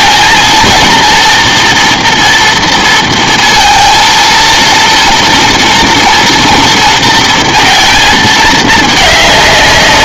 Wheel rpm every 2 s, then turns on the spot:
230, 230, 230, 230, 210.
none